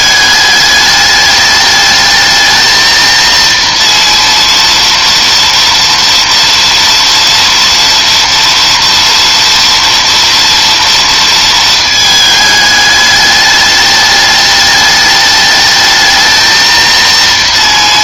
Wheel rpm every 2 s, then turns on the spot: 210, 220, 230, 230, 230, 230, 210, 210, 230.
none